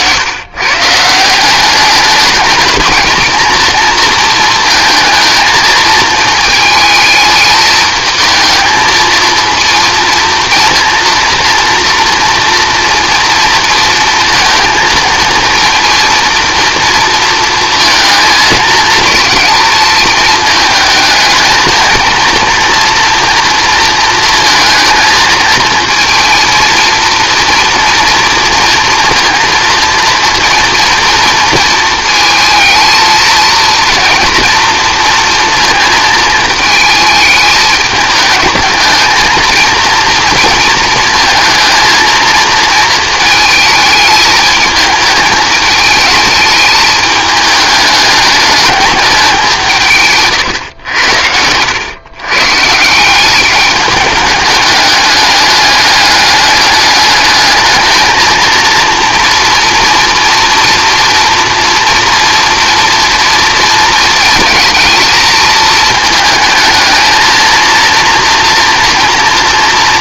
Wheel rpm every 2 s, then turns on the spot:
140, 220, 230, 220, 220, 240, 230, 230, 230, 220, 220, 230, 230, 230, 230, 240, 220, 230, 220, 210, 230, 230, 220, 210, 210, 110, 160, 210, 210, 230, 230, 230, 220, 220, 240.
none